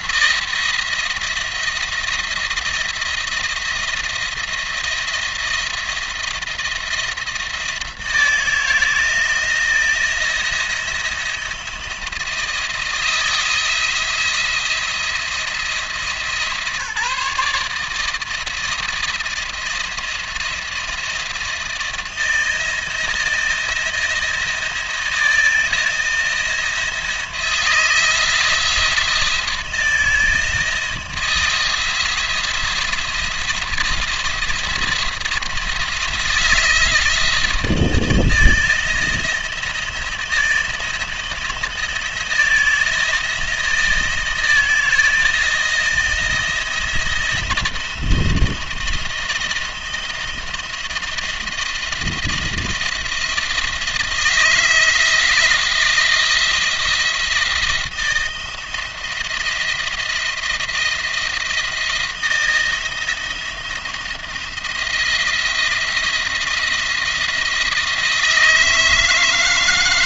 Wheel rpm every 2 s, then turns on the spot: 170, 170, 170, 170, 160, 170, 160, 170, 150, 160, 170, 160, 170, 170, 170, 160, 160, 170, 170, 160, 160, 170, 160, 170, 170, 160, 170, 170, 170, 170, 170, 170, 170, 170, 160.
none